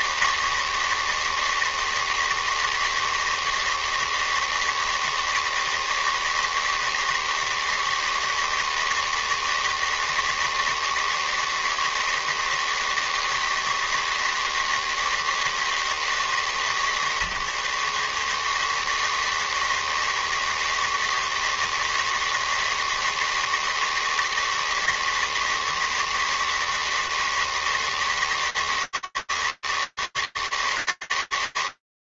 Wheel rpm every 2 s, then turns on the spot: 160, 160, 160, 160, 160, 160, 160, 160, 130, 160, 160, 160, 160, 160, 160, 160.
none